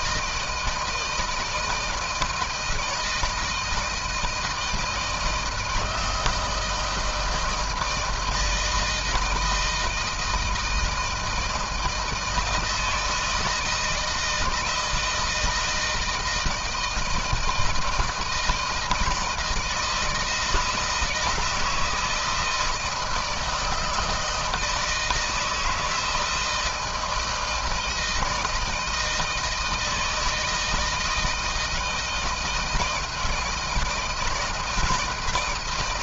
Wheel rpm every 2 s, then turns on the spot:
160, 160, 160, 160, 160, 160, 160, 160, 160, 160, 160, 160, 160, 160, 160, 160, 160, 170.
none